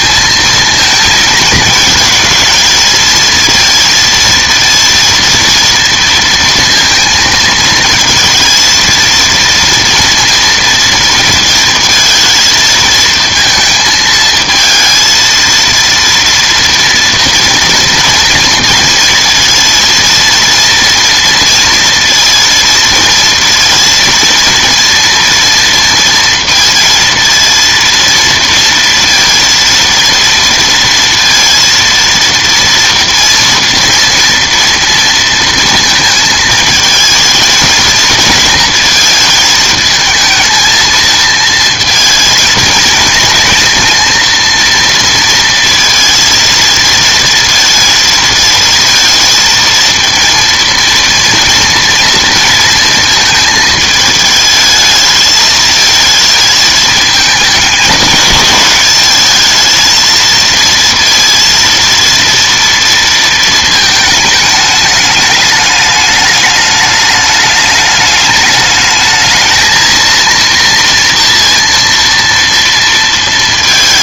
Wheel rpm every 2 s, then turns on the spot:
230, 220, 230, 230, 230, 230, 220, 220, 230, 230, 230, 230, 230, 230, 230, 230, 230, 230, 220, 230, 230, 230, 230, 230, 220, 230, 230, 220, 220, 210, 230, 230, 210, 210, 220, 230, 230.
none